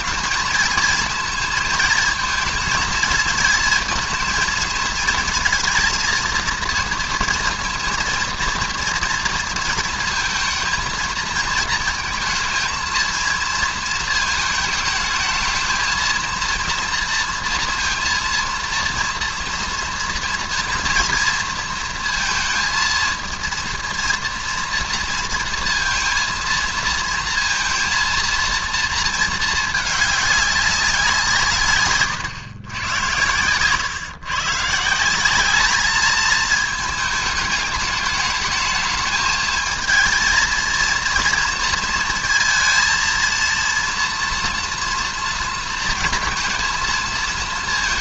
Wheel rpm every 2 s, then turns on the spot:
220, 230, 230, 230, 230, 220, 230, 220, 230, 230, 230, 230, 230, 230, 230, 200, 120, 140, 220, 220, 230, 230, 240, 230.
none